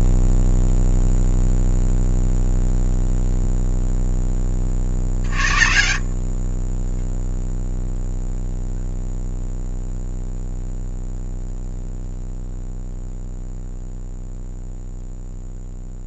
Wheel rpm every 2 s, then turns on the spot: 0, 0, 40, 20, 0, 0, 0, 0.
none